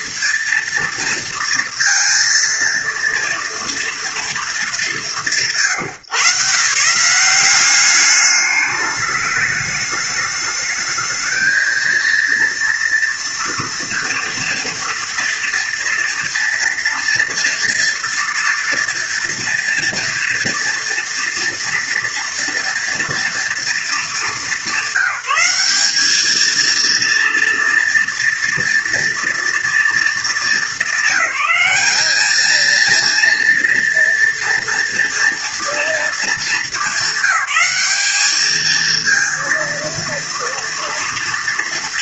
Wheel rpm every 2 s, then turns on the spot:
230, 230, 210, 150, 210, 220, 230, 230, 230, 230, 230, 230, 200, 230, 230, 210, 220, 230, 210, 220, 230.
none